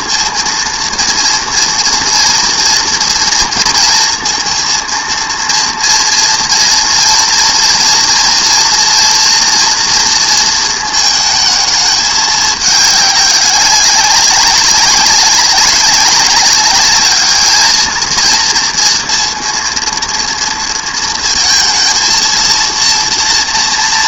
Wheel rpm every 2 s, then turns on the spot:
240, 230, 230, 230, 230, 230, 200, 190, 200, 230, 230, 230.
none